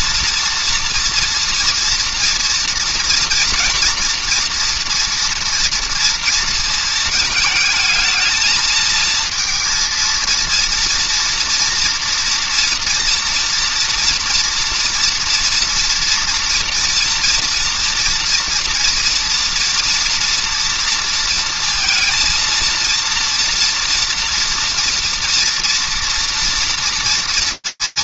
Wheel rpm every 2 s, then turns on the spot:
230, 230, 230, 230, 220, 230, 240, 230, 230, 230, 230, 230, 230, 230.
none